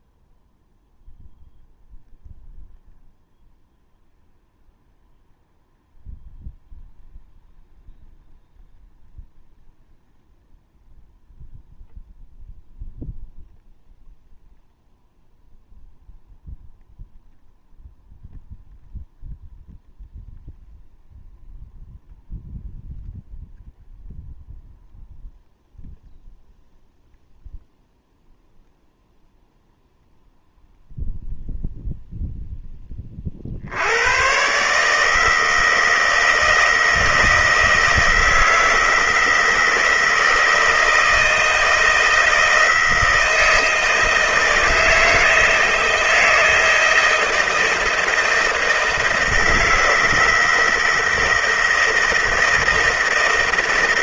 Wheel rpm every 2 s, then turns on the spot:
0, 0, 0, 0, 0, 0, 0, 0, 0, 0, 0, 0, 0, 0, 0, 0, 20, 150, 160, 160, 160, 160, 160, 160, 160, 160, 160.
none